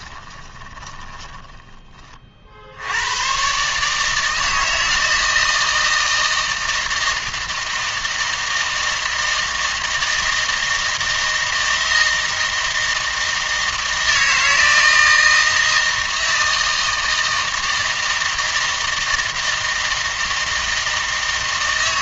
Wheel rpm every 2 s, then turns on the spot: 20, 70, 160, 160, 160, 160, 160, 160, 160, 160, 160.
0-2